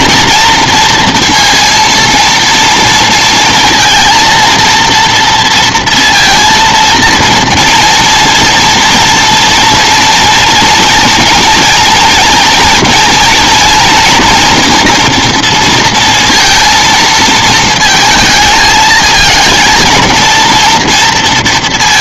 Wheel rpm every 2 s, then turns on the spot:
230, 230, 230, 230, 230, 230, 230, 230, 230, 220, 230.
none